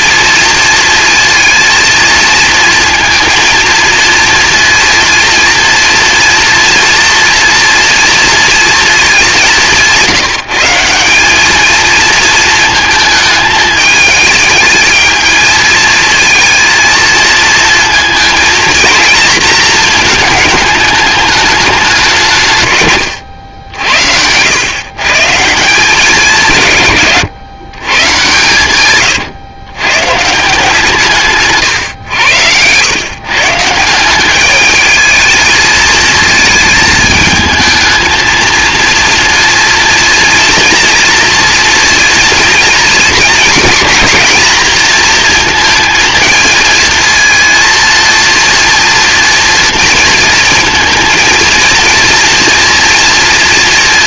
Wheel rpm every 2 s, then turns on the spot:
230, 220, 230, 240, 220, 170, 220, 220, 230, 230, 210, 130, 120, 150, 120, 160, 100, 210, 220, 230, 230, 230, 230, 230, 230, 230, 230.
22-24